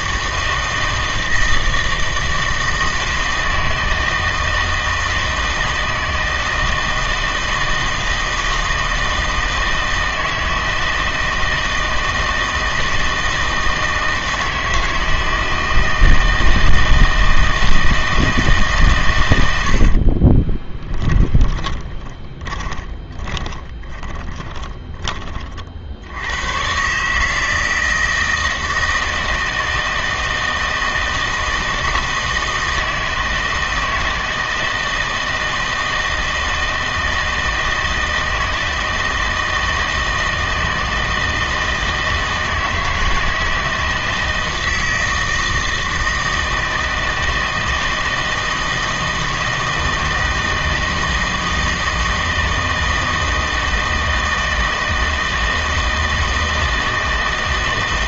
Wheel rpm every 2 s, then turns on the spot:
160, 160, 160, 160, 160, 160, 160, 160, 160, 150, 20, 20, 20, 130, 160, 160, 160, 160, 160, 160, 160, 160, 160, 160, 160, 160, 160, 160, 160.
20-26